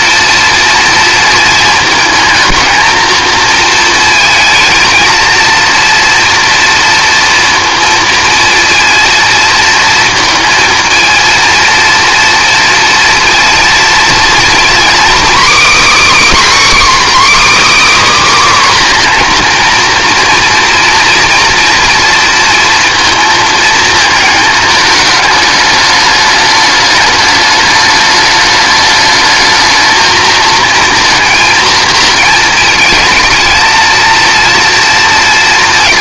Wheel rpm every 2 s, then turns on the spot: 230, 220, 230, 230, 230, 220, 230, 250, 300, 270, 230, 230, 210, 210, 210, 230, 230, 230.
none